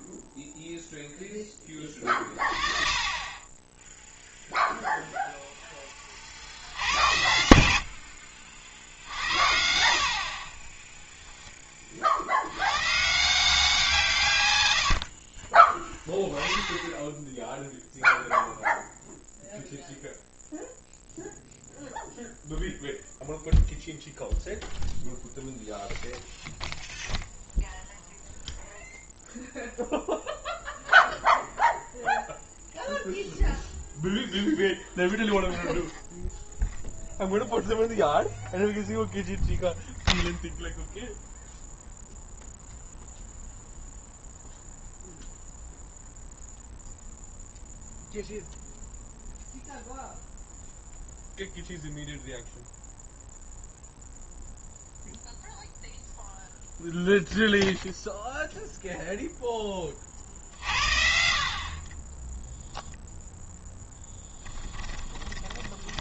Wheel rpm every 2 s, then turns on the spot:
0, 30, 0, 80, 70, 20, 120, 90, 10, 0, 0, 0, 0, 0, 0, 0, 0, 0, 0, 0, 0, 0, 0, 0, 0, 0, 0, 0, 0, 0, 50, 0, 20.
14-16 64-66